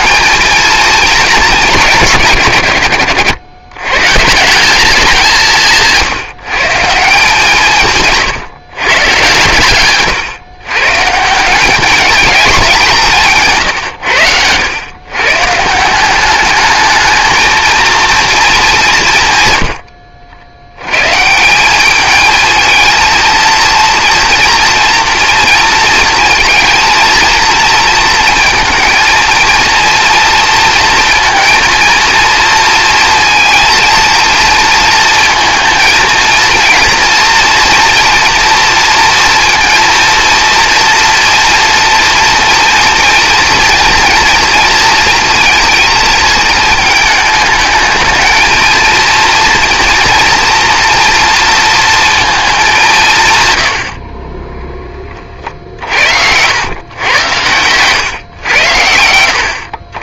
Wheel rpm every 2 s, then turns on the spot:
120, 190, 160, 130, 160, 170, 130, 220, 150, 140, 230, 230, 230, 230, 230, 230, 230, 230, 230, 230, 230, 230, 220, 230, 230, 160, 30, 110, 80, 160.
none